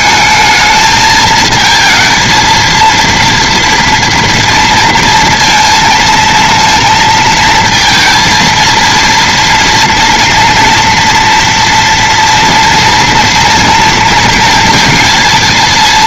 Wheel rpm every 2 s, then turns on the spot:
220, 230, 230, 230, 230, 240, 230, 230.
none